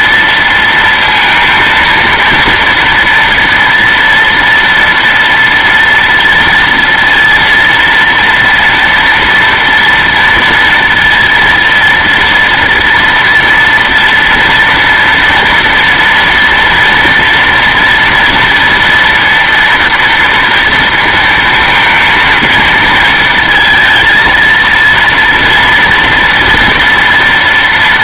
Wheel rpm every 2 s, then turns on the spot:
230, 230, 230, 230, 230, 230, 230, 230, 230, 240, 230, 230, 230, 230.
none